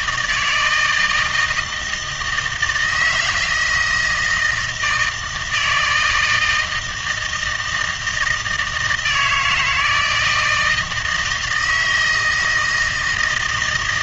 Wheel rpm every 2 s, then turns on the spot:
160, 160, 160, 170, 160, 160, 160.
none